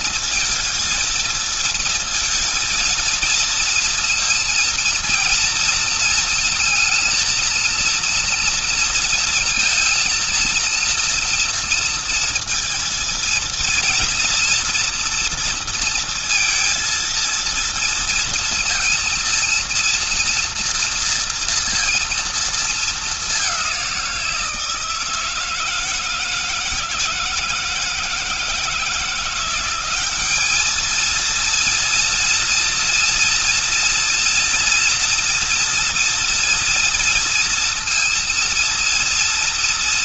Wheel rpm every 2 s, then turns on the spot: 230, 230, 230, 230, 230, 230, 230, 230, 230, 230, 230, 230, 170, 160, 160, 200, 230, 230, 230, 230.
none